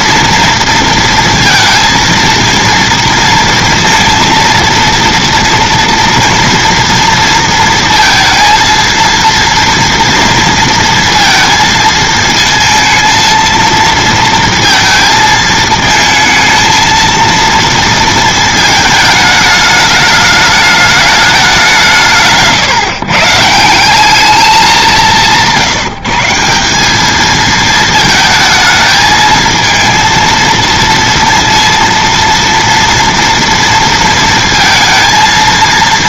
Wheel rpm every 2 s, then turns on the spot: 230, 230, 230, 230, 230, 230, 230, 230, 220, 220, 210, 170, 200, 180, 220, 230, 230, 230.
none